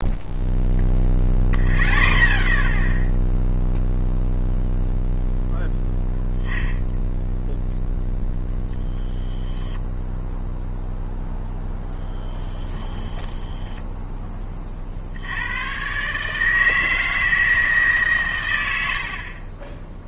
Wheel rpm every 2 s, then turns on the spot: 0, 0, 0, 0, 0, 0, 30, 30, 160, 90.
12-14